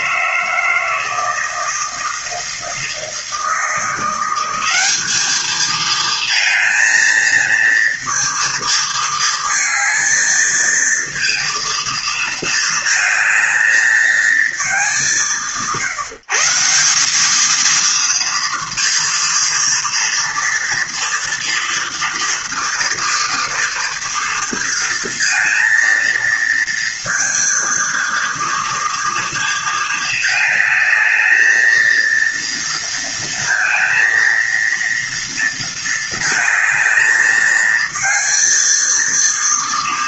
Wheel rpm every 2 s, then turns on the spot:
160, 160, 180, 230, 230, 220, 230, 220, 160, 230, 230, 230, 230, 230, 230, 220, 230, 230, 230, 230.
none